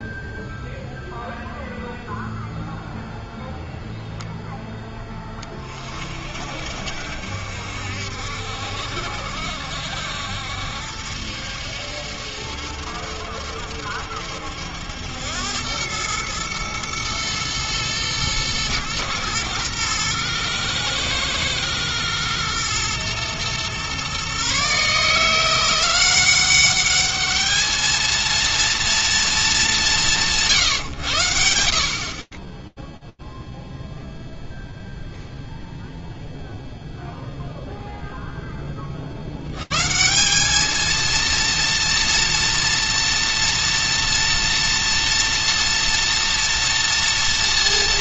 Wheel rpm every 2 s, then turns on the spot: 0, 0, 10, 70, 70, 70, 70, 90, 120, 110, 110, 120, 150, 210, 230, 120, 0, 0, 0, 180, 230, 230, 230, 230.
none